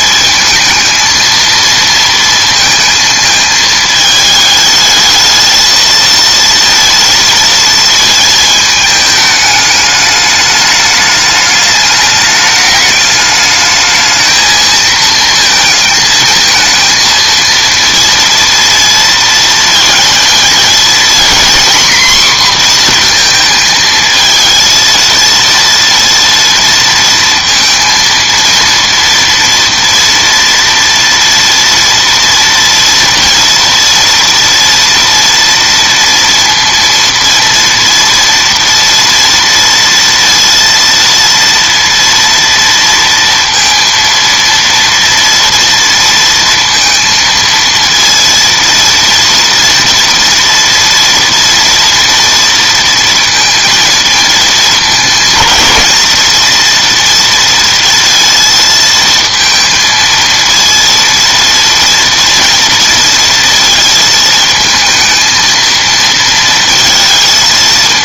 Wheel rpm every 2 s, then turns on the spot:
230, 220, 220, 230, 210, 210, 210, 220, 230, 230, 240, 240, 230, 230, 230, 230, 230, 230, 230, 230, 230, 230, 230, 230, 230, 230, 230, 210, 230, 230, 230, 230, 220, 230.
none